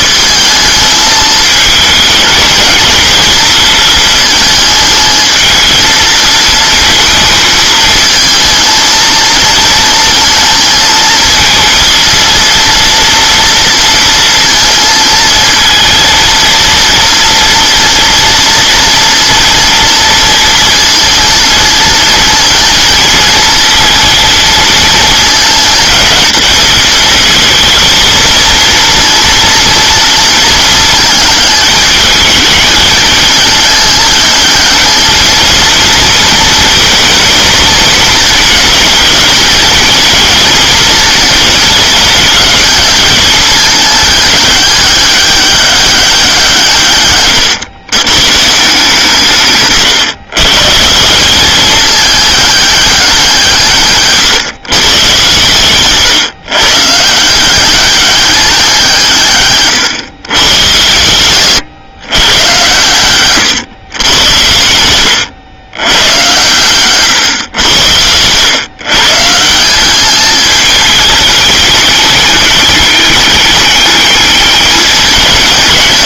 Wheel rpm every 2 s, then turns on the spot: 220, 220, 220, 220, 230, 220, 230, 230, 230, 230, 230, 230, 220, 220, 230, 220, 220, 210, 230, 230, 220, 210, 210, 160, 150, 150, 200, 140, 140, 180, 110, 110, 90, 120, 130, 220, 210, 210.
none